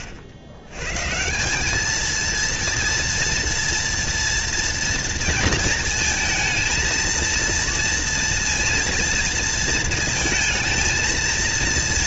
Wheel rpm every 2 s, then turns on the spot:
90, 230, 230, 230, 230, 220.
none